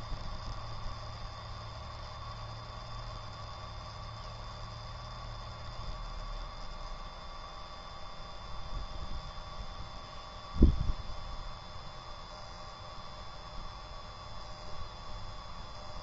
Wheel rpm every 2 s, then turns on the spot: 0, 0, 0, 0, 0, 0, 0, 0.
none